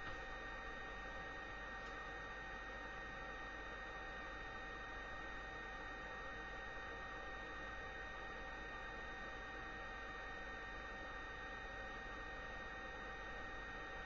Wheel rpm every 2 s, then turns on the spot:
0, 0, 0, 0, 0, 0, 0.
none